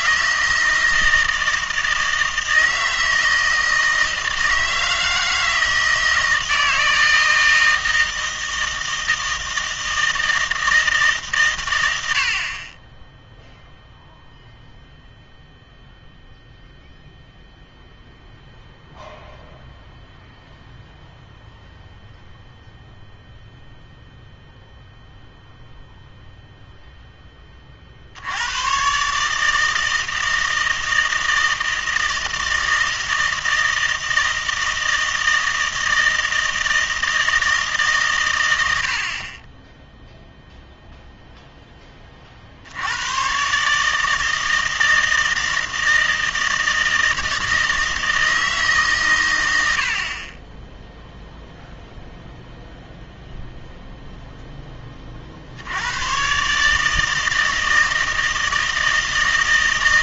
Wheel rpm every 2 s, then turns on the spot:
160, 160, 160, 160, 160, 160, 20, 0, 0, 0, 0, 0, 0, 0, 110, 160, 160, 160, 160, 80, 0, 80, 160, 160, 150, 10, 0, 10, 150, 160.
none